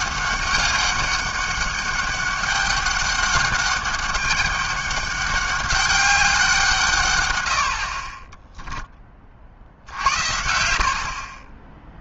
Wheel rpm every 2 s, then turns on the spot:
200, 200, 200, 180, 10, 80.
8-10